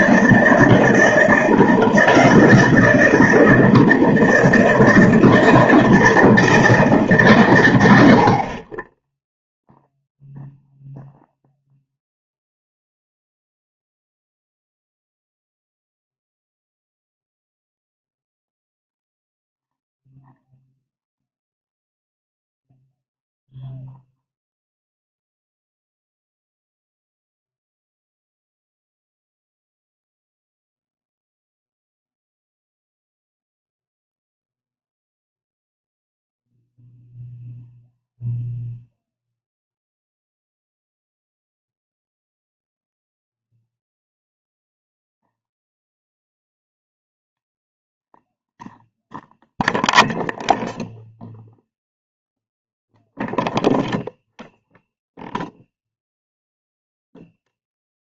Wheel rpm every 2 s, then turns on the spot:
160, 160, 160, 150, 20, 0, 0, 0, 0, 0, 0, 0, 0, 0, 0, 0, 0, 0, 0, 0, 0, 0, 0, 0, 0, 0, 0, 0, 0.
none